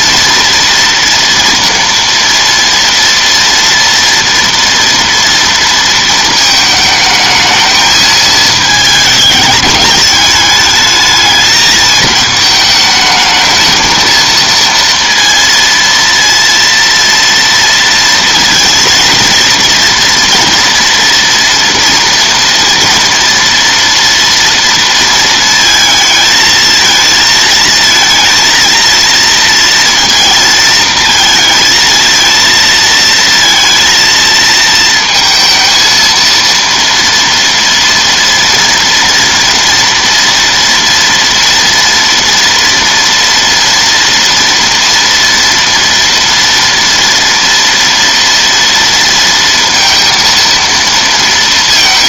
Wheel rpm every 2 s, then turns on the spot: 230, 230, 230, 220, 220, 210, 220, 230, 230, 230, 240, 230, 230, 220, 230, 230, 230, 230, 230, 230, 230, 230, 230, 230, 230, 230.
none